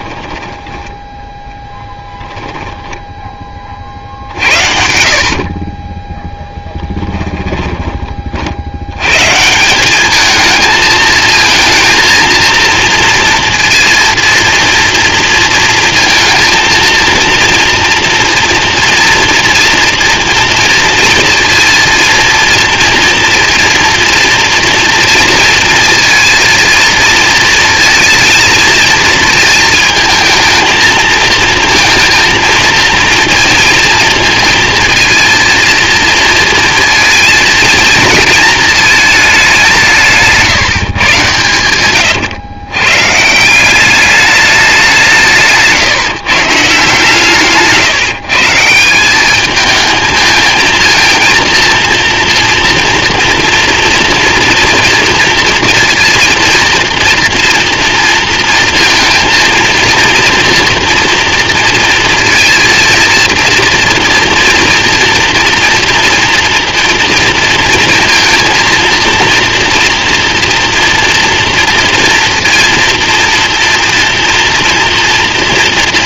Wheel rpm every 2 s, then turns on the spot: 10, 10, 60, 10, 90, 220, 230, 230, 230, 240, 230, 230, 230, 230, 230, 220, 230, 230, 230, 220, 150, 120, 190, 150, 170, 230, 240, 230, 230, 230, 230, 230, 230, 230, 230, 230, 230, 230.
0-4 6-8